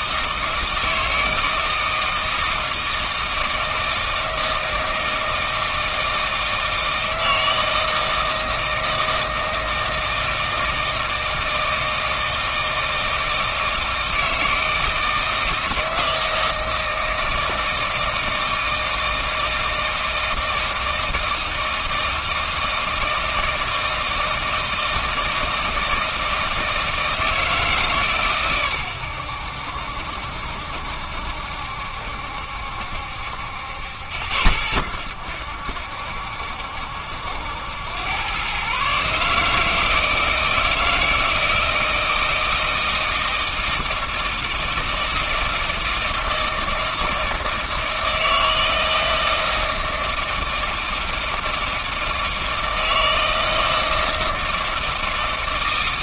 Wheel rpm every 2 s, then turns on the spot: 160, 160, 160, 160, 160, 160, 160, 160, 160, 160, 160, 160, 160, 160, 120, 70, 70, 80, 70, 130, 160, 160, 160, 160, 160, 160, 160, 160.
none